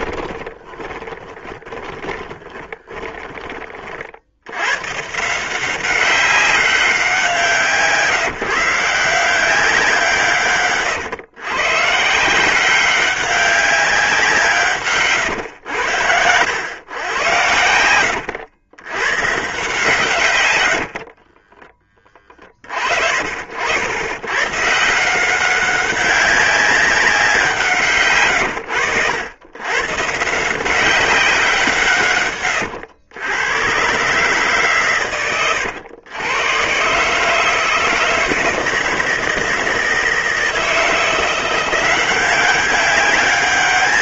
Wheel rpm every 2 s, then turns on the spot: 20, 10, 120, 190, 160, 140, 190, 140, 110, 110, 90, 40, 150, 190, 100, 170, 90, 130, 130, 160, 170, 200.
0-4 20-22